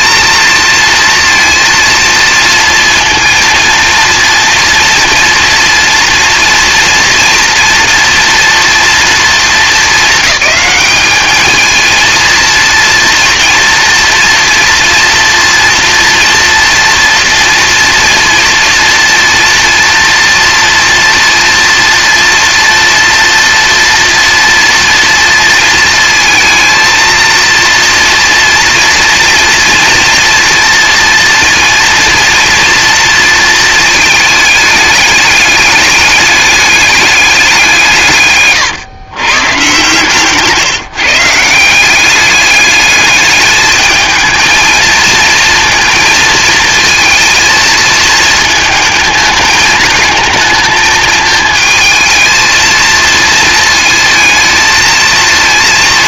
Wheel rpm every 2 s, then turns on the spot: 230, 230, 240, 230, 230, 210, 230, 230, 240, 230, 230, 230, 230, 230, 230, 230, 230, 210, 210, 130, 160, 210, 220, 230, 220, 220, 230, 220.
none